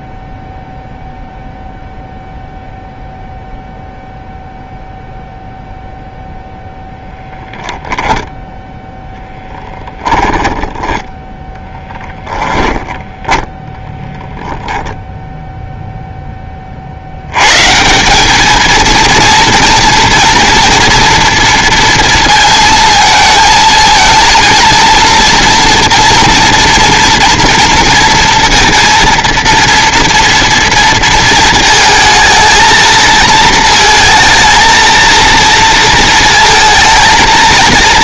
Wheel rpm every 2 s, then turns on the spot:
0, 0, 0, 0, 0, 10, 20, 10, 30, 220, 230, 230, 230, 230, 230, 230, 220, 230, 220.
10-12 14-16